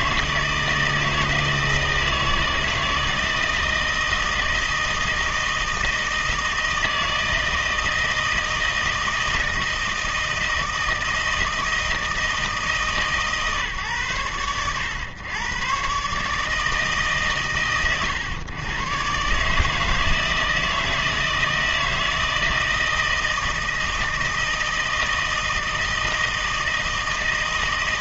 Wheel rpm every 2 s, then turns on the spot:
160, 160, 160, 160, 160, 160, 150, 110, 160, 120, 160, 160, 160, 160.
none